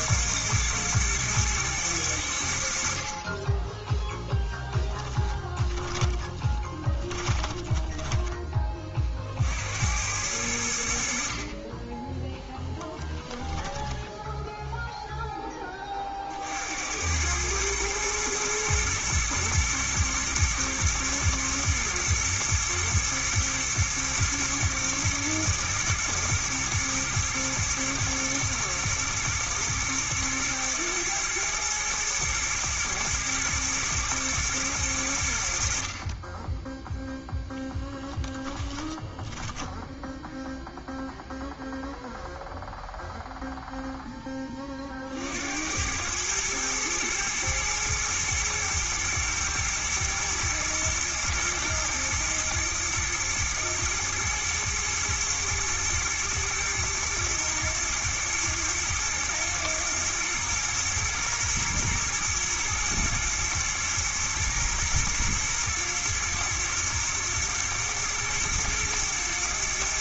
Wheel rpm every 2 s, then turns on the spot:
110, 60, 10, 20, 30, 70, 20, 0, 90, 110, 110, 120, 120, 110, 110, 120, 120, 100, 0, 10, 0, 0, 40, 110, 110, 110, 120, 110, 110, 110, 120, 110, 110, 110, 110.
4-8 12-14 38-40